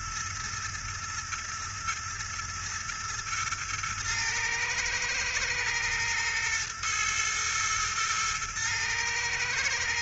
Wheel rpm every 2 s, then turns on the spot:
120, 120, 110, 120, 110.
none